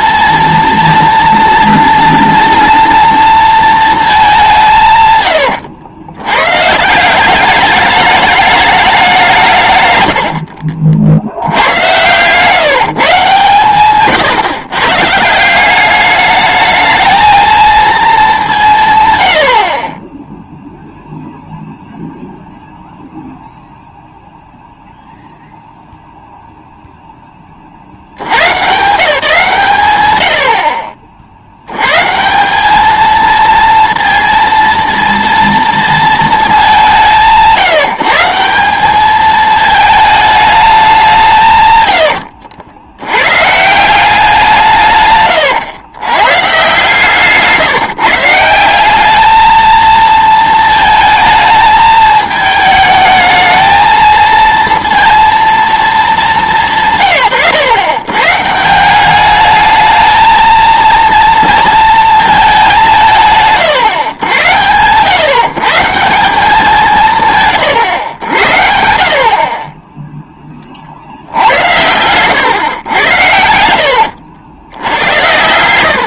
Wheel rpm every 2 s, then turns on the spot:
230, 230, 160, 140, 210, 60, 150, 120, 220, 160, 0, 0, 0, 0, 140, 50, 210, 230, 190, 190, 200, 80, 160, 140, 190, 220, 220, 230, 150, 180, 230, 190, 110, 180, 70, 40, 110, 80.
none